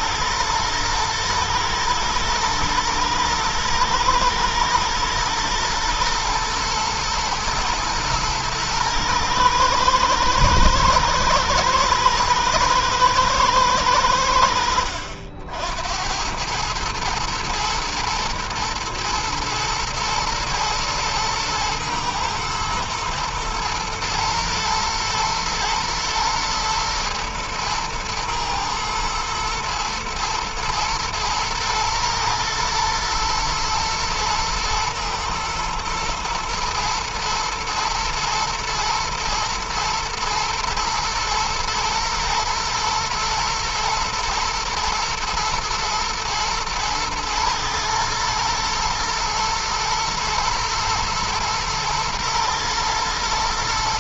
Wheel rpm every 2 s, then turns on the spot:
110, 120, 120, 120, 110, 110, 110, 70, 110, 110, 110, 110, 120, 120, 110, 120, 110, 120, 110, 110, 110, 120, 120, 110, 110, 110, 110.
none